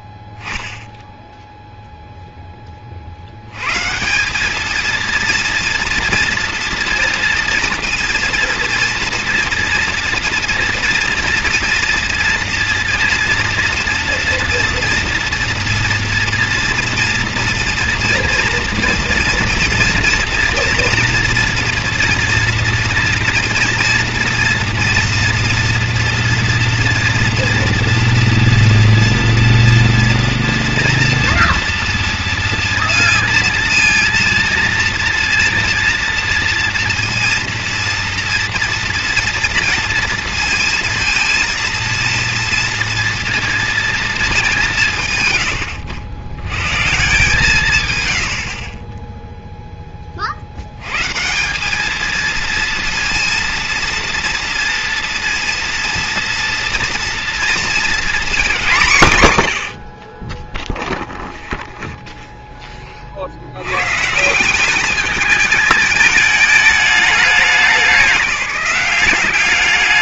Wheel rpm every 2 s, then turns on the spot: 0, 20, 210, 230, 230, 240, 230, 240, 230, 240, 230, 240, 240, 230, 240, 230, 230, 230, 230, 230, 230, 230, 180, 130, 40, 90, 230, 230, 230, 210, 10, 10, 190, 210, 190.
none